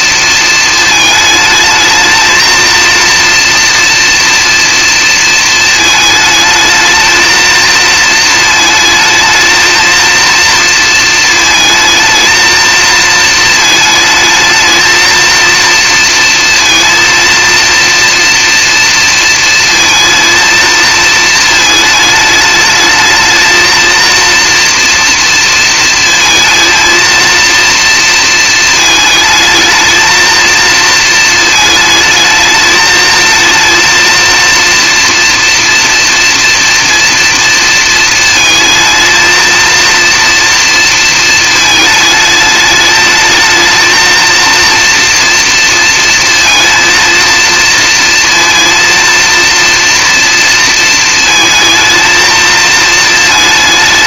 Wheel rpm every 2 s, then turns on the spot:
220, 230, 230, 220, 220, 230, 230, 220, 230, 230, 230, 210, 230, 230, 220, 220, 220, 230, 240, 220, 230, 220, 230, 230, 230, 230, 220.
none